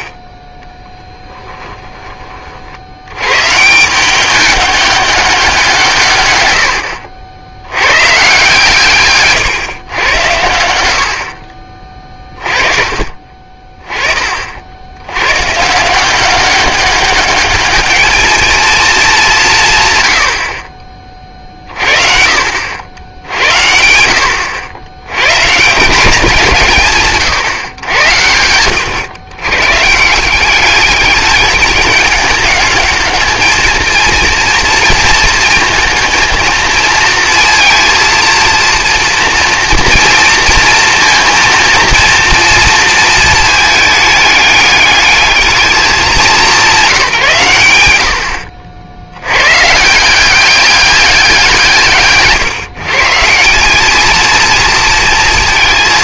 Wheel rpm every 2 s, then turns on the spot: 30, 40, 200, 100, 140, 90, 30, 50, 190, 220, 60, 80, 90, 160, 100, 190, 210, 230, 230, 230, 230, 230, 210, 180, 60, 190, 140, 230.
0-2